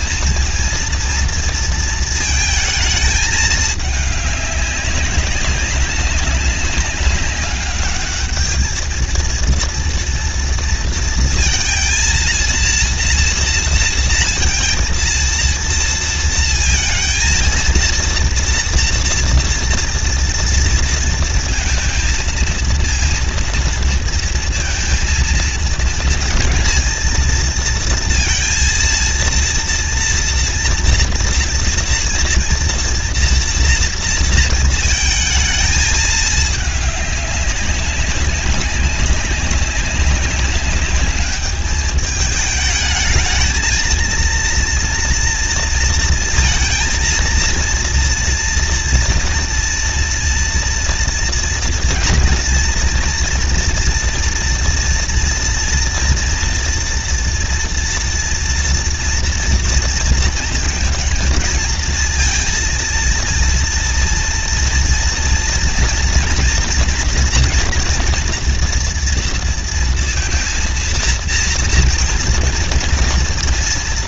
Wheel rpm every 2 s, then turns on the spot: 230, 220, 200, 190, 210, 230, 230, 230, 230, 230, 230, 230, 230, 220, 230, 240, 230, 230, 210, 200, 200, 210, 230, 230, 230, 230, 230, 230, 230, 230, 230, 230, 230, 240, 240, 230, 230.
none